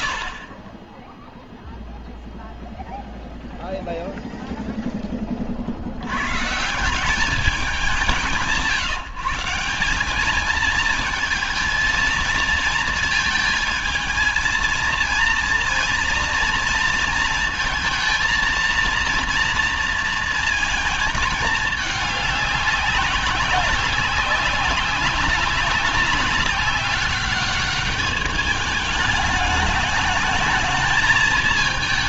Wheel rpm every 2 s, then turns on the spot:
40, 0, 0, 140, 150, 210, 230, 230, 230, 230, 230, 200, 190, 200, 210, 220.
none